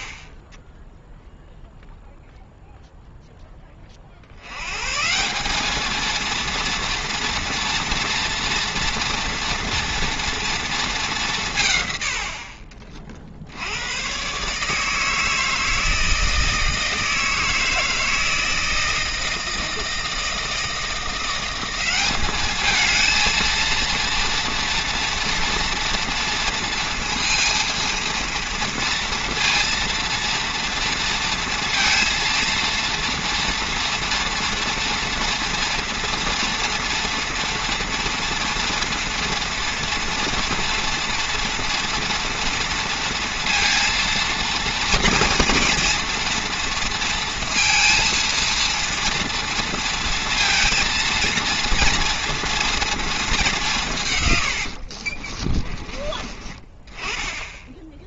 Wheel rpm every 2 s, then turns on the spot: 10, 0, 100, 230, 230, 220, 50, 150, 160, 160, 170, 220, 230, 230, 230, 230, 230, 230, 240, 230, 230, 230, 220, 230, 230, 230, 230, 70, 20.
54-56